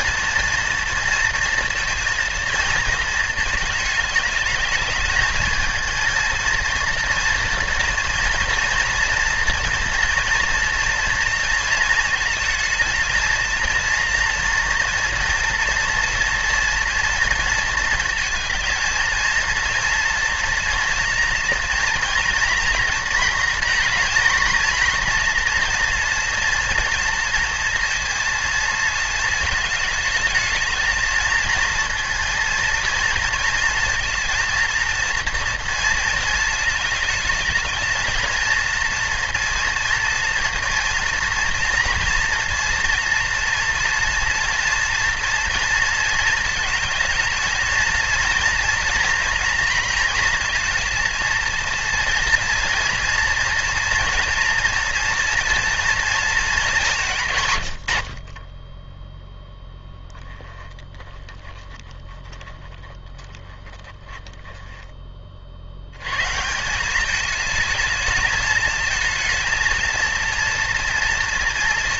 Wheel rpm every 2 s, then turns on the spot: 230, 230, 210, 230, 230, 230, 230, 230, 240, 230, 230, 230, 230, 230, 230, 220, 230, 230, 220, 230, 230, 230, 230, 220, 240, 230, 230, 230, 210, 20, 10, 10, 10, 170, 220, 230.
58-60